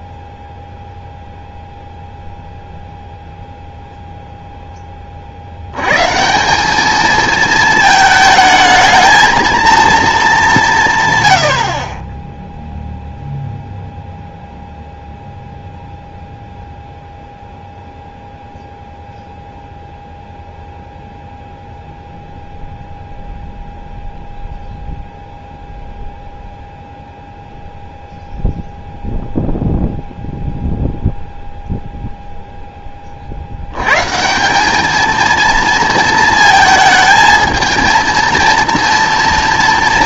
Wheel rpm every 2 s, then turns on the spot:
0, 0, 10, 190, 220, 170, 0, 0, 0, 0, 0, 0, 0, 0, 0, 0, 0, 200, 230, 230.
none